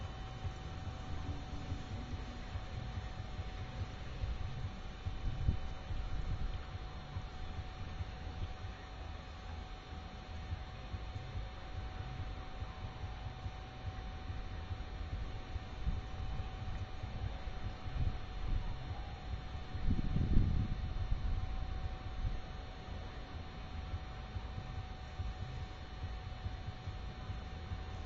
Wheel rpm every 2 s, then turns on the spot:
0, 0, 0, 0, 0, 0, 0, 0, 0, 0, 0, 0, 0, 0.
none